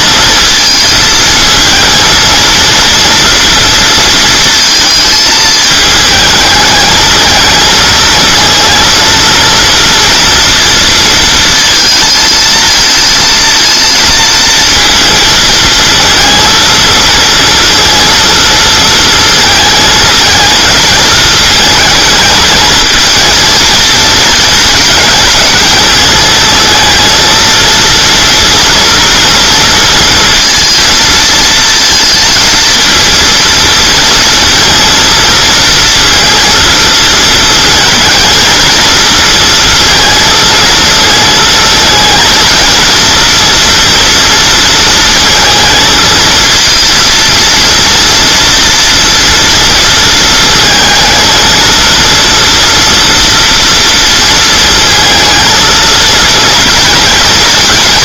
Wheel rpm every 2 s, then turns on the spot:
230, 230, 220, 220, 230, 230, 230, 230, 230, 220, 220, 220, 230, 220, 230, 230, 230, 230, 230, 220, 220, 230, 230, 230, 230, 230, 230, 230, 230.
none